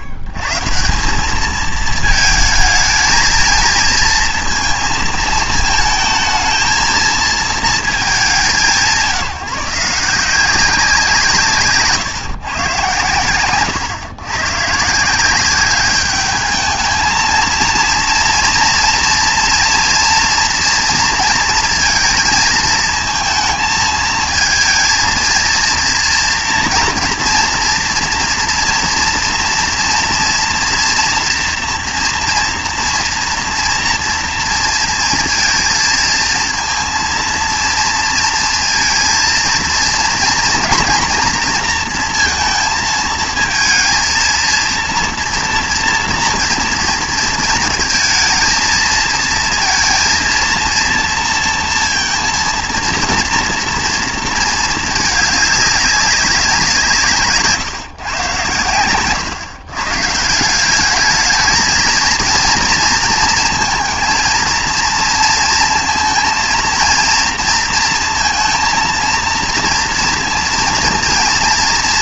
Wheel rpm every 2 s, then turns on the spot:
110, 220, 230, 220, 180, 180, 120, 140, 210, 230, 230, 220, 230, 240, 230, 230, 230, 230, 230, 230, 230, 220, 230, 230, 230, 230, 230, 220, 180, 110, 200, 230, 230, 230, 230, 230.
none